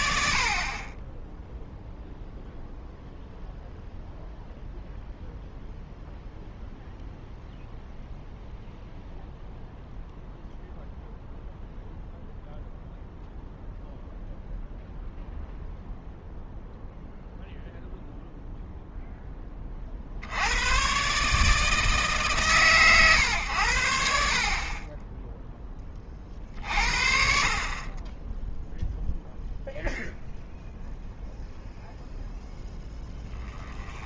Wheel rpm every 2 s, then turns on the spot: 40, 0, 0, 0, 0, 0, 0, 0, 0, 0, 110, 130, 30, 50, 0, 0, 10.
none